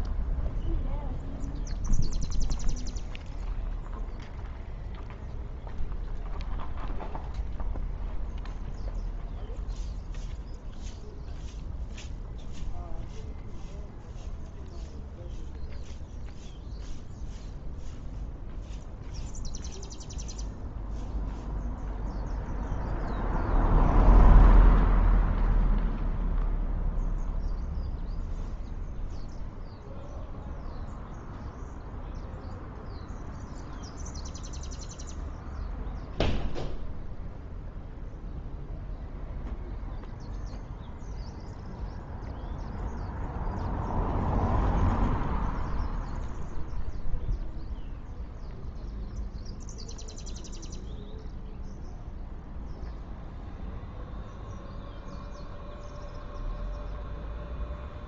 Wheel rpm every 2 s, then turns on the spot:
0, 0, 0, 0, 0, 0, 0, 0, 0, 0, 0, 0, 0, 0, 0, 0, 0, 0, 0, 0, 0, 0, 0, 0, 0, 0, 0, 0, 0.
none